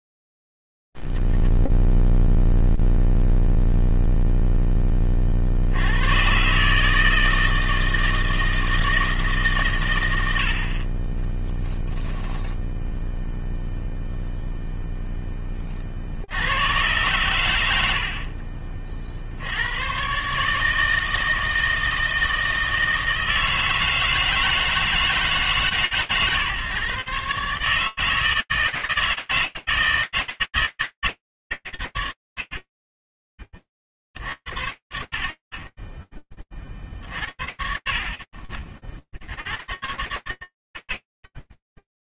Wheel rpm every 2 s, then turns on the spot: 0, 0, 20, 150, 160, 30, 0, 0, 110, 50, 160, 160, 150, 140, 160, 100, 20, 60, 60, 40, 70.
none